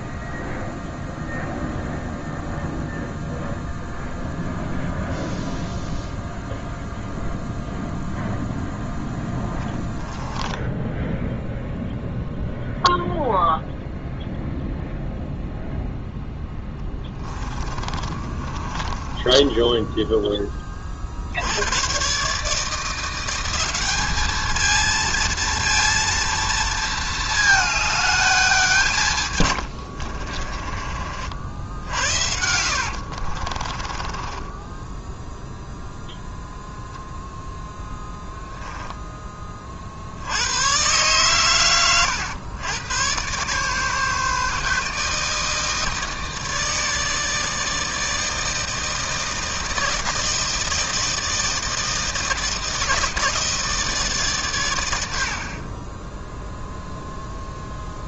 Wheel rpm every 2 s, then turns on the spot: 0, 0, 0, 0, 0, 10, 0, 0, 10, 30, 30, 160, 220, 230, 190, 40, 80, 10, 0, 0, 100, 110, 150, 160, 160, 160, 160, 110, 0.
10-12 16-20 30-36